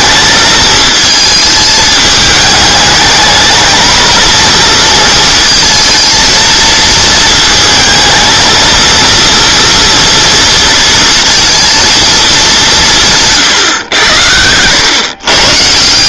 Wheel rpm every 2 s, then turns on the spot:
220, 210, 230, 220, 230, 230, 190, 100.
none